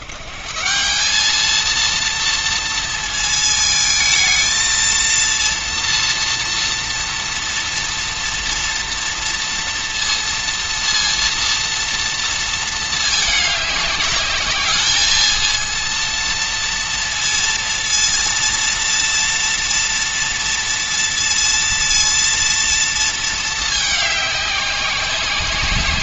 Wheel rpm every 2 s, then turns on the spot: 190, 230, 230, 230, 230, 230, 220, 220, 230, 230, 230, 230, 190.
none